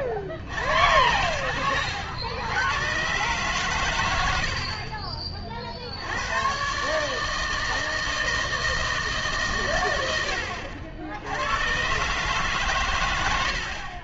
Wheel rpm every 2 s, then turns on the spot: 50, 110, 50, 130, 160, 60, 140.
none